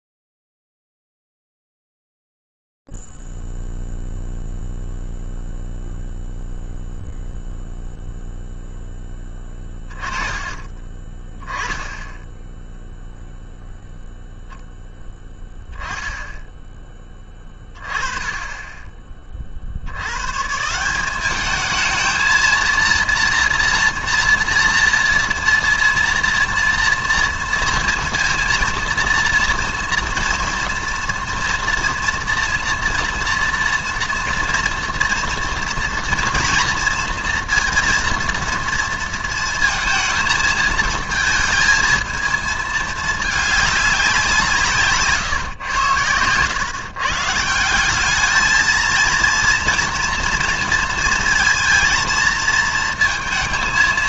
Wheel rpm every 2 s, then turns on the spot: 0, 0, 0, 0, 0, 20, 10, 0, 10, 20, 150, 230, 240, 230, 230, 230, 240, 230, 230, 230, 220, 220, 160, 130, 230, 230, 230.
none